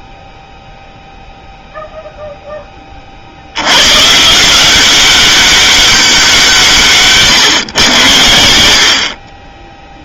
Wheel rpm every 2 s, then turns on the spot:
0, 10, 170, 170, 80.
none